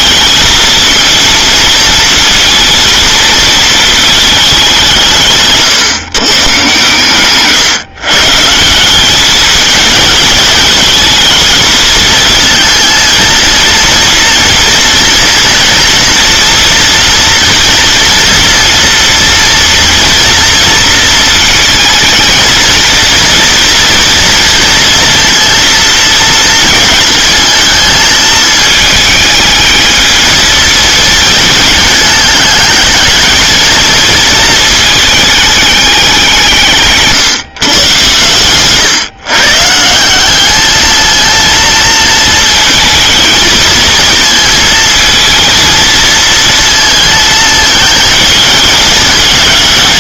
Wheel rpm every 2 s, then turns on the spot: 230, 230, 200, 130, 160, 220, 230, 230, 240, 230, 230, 220, 230, 230, 220, 220, 210, 220, 160, 120, 210, 220, 220, 230, 220.
38-40